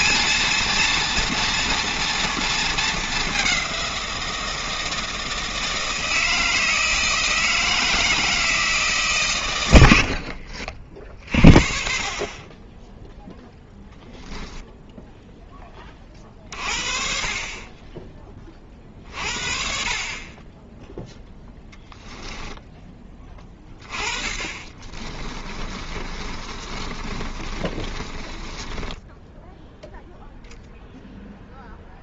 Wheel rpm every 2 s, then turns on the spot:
230, 220, 160, 160, 160, 40, 20, 0, 50, 30, 10, 10, 30, 30, 20, 0.
24-30